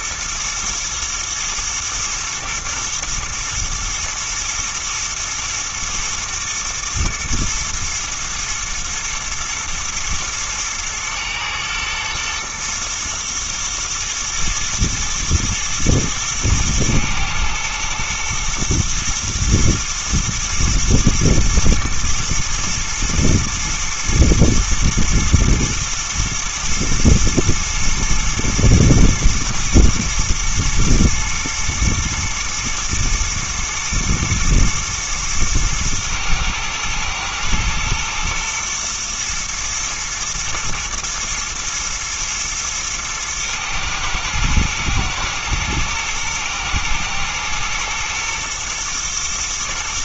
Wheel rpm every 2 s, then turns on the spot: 120, 110, 120, 120, 110, 110, 110, 110, 110, 110, 110, 120, 110, 110, 120, 110, 120, 120, 110, 120, 120, 110, 110, 110, 120.
none